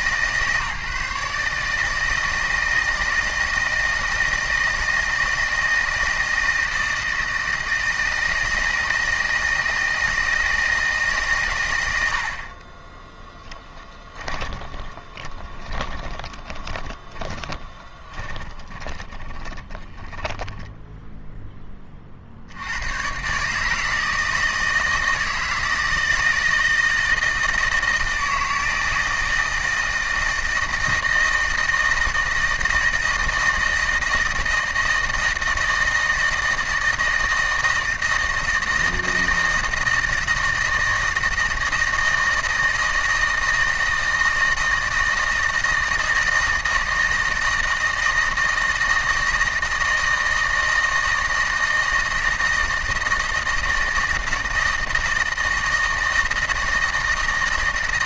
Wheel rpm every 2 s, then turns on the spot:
150, 160, 160, 160, 160, 160, 70, 20, 20, 20, 10, 50, 160, 160, 160, 160, 160, 160, 160, 160, 160, 160, 160, 160, 160, 160, 160, 160, 160.
14-22